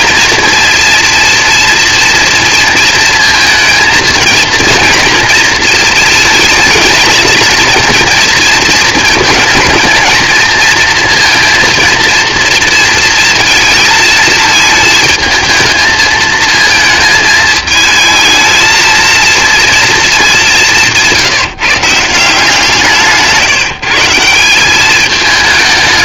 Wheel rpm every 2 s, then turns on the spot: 230, 230, 230, 220, 220, 230, 230, 220, 220, 230, 160, 160, 210.
none